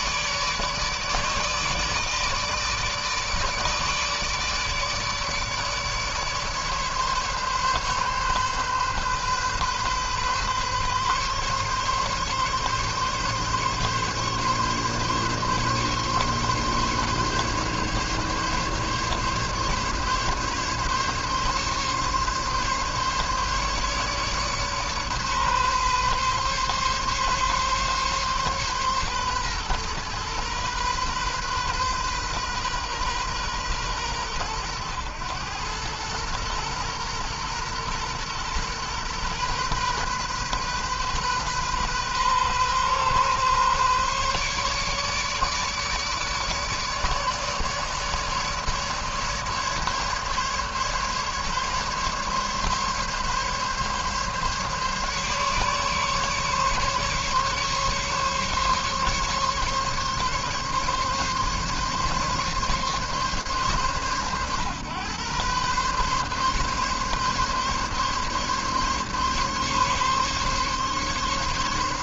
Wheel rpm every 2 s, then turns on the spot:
150, 150, 150, 150, 140, 140, 140, 140, 140, 140, 140, 140, 140, 140, 130, 120, 130, 110, 120, 120, 130, 130, 140, 150, 150, 140, 140, 140, 140, 140, 140, 140, 120, 140, 140, 140.
none